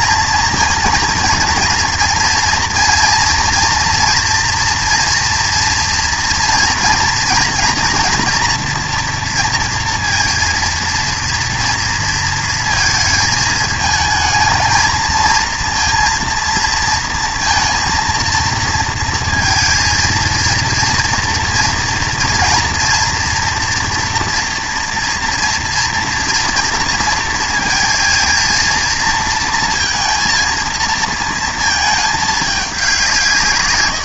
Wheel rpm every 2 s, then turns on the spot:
230, 230, 230, 230, 230, 230, 230, 220, 230, 230, 230, 230, 230, 230, 230, 230, 210.
none